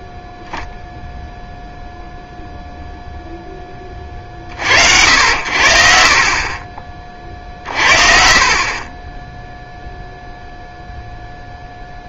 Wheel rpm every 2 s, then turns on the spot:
0, 0, 60, 30, 20, 0.
none